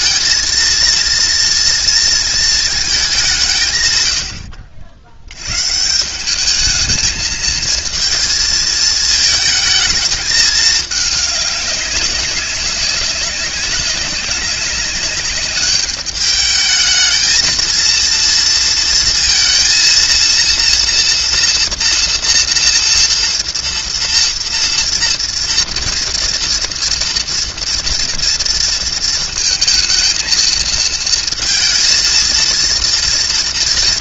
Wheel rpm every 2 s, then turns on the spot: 230, 220, 70, 210, 220, 210, 190, 200, 210, 230, 230, 230, 230, 230, 230, 220, 230.
none